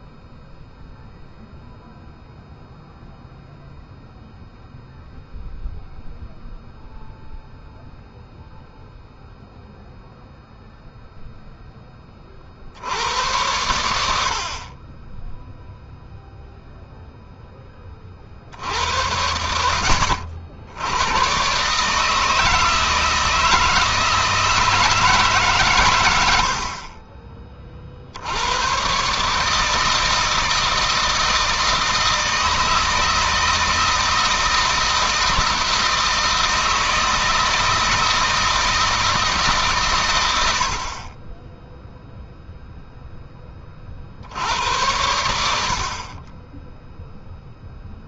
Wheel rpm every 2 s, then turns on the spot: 0, 0, 0, 0, 0, 0, 80, 30, 0, 80, 100, 160, 160, 40, 120, 160, 160, 160, 160, 160, 60, 10, 100, 0.
none